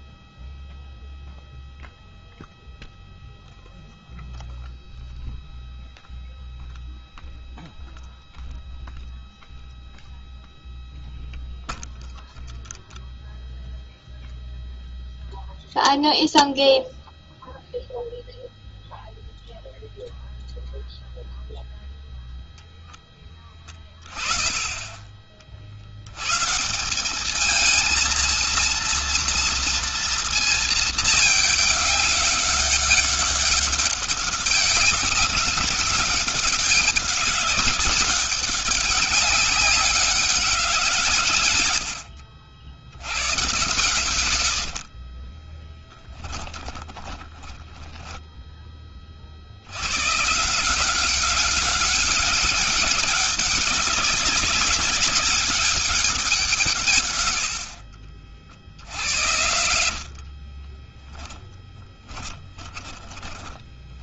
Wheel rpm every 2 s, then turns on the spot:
0, 0, 0, 0, 0, 0, 0, 0, 0, 0, 0, 0, 20, 170, 230, 220, 200, 200, 200, 200, 170, 90, 50, 20, 20, 180, 190, 200, 140, 70, 20, 20.
46-48 60-64